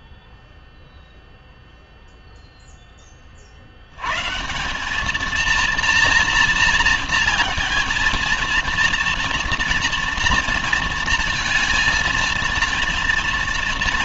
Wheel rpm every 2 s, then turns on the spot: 0, 0, 150, 230, 230, 230, 230.
none